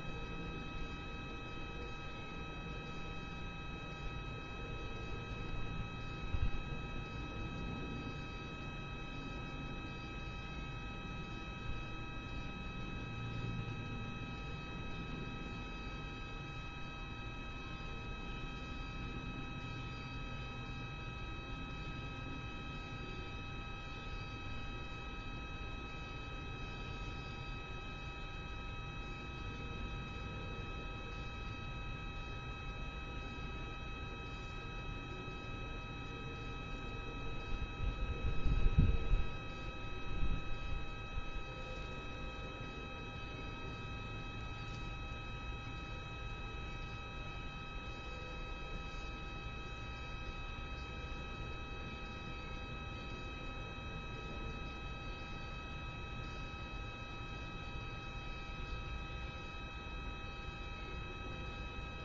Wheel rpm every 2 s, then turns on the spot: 0, 0, 0, 0, 0, 0, 0, 0, 0, 0, 0, 0, 0, 0, 0, 0, 0, 0, 0, 0, 0, 0, 0, 0, 0, 0, 0, 0, 0, 0, 0.
none